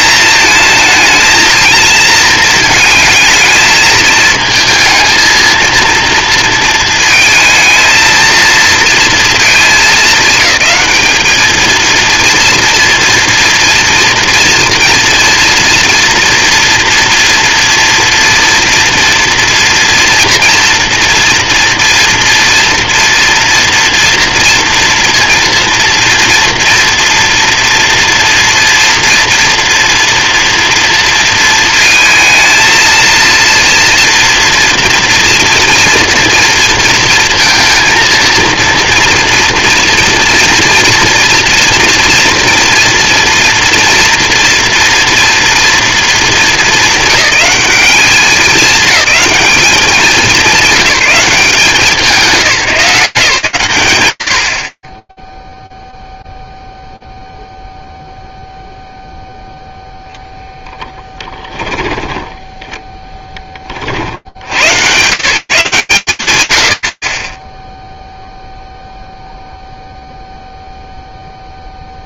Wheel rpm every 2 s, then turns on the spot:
220, 220, 230, 220, 230, 210, 230, 230, 230, 230, 230, 230, 230, 240, 230, 230, 230, 230, 230, 230, 230, 230, 240, 200, 210, 190, 190, 70, 0, 0, 0, 10, 100, 130, 0, 0.
62-64